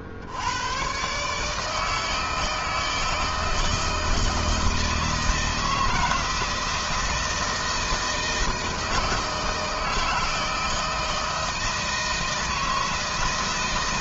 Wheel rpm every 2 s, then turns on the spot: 110, 160, 160, 160, 160, 160, 160.
none